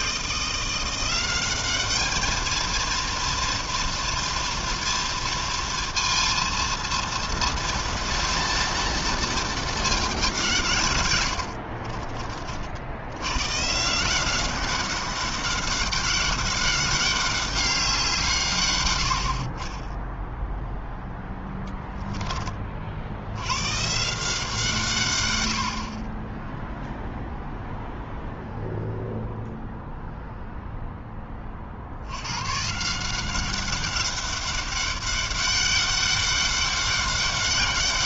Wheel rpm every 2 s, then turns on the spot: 190, 230, 230, 230, 220, 90, 110, 200, 200, 60, 10, 90, 110, 0, 0, 20, 180, 200, 200.
10-12